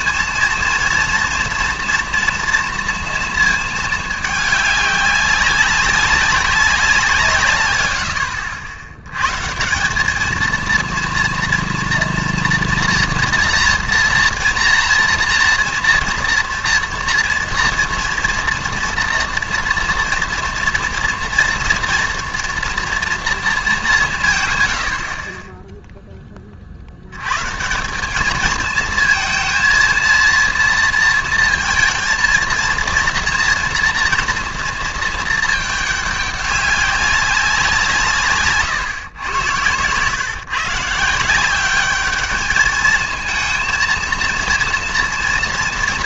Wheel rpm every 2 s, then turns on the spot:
230, 230, 210, 200, 80, 230, 240, 230, 230, 230, 230, 230, 120, 40, 220, 230, 230, 230, 200, 140, 140, 210, 230.
none